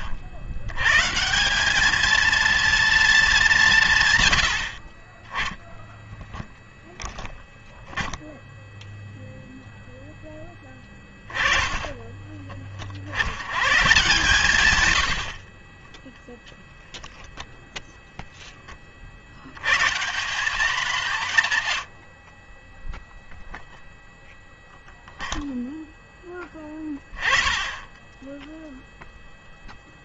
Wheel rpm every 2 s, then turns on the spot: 90, 230, 60, 10, 0, 10, 30, 130, 10, 20, 190, 20, 0, 10, 0.
10-12 16-18 22-24